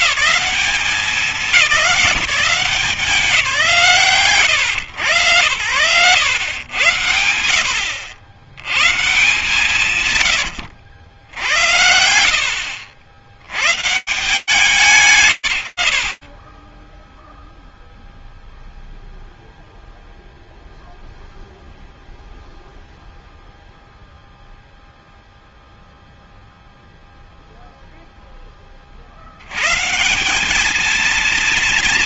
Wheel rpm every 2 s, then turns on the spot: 190, 160, 100, 70, 130, 80, 130, 90, 0, 0, 0, 0, 0, 20, 190, 220.
8-10